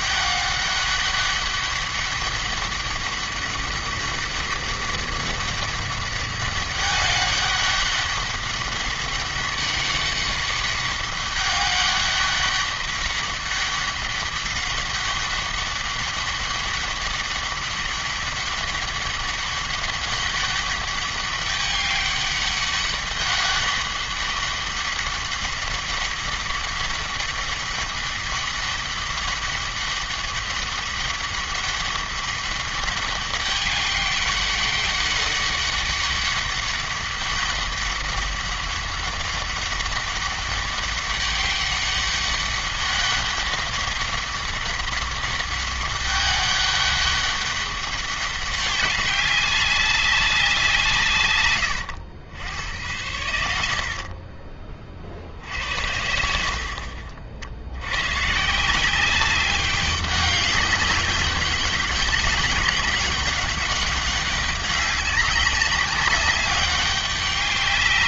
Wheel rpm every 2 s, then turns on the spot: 200, 200, 200, 200, 200, 200, 200, 200, 200, 200, 200, 200, 200, 200, 200, 200, 200, 200, 200, 200, 200, 200, 200, 200, 200, 180, 90, 30, 60, 170, 200, 190, 200, 200.
none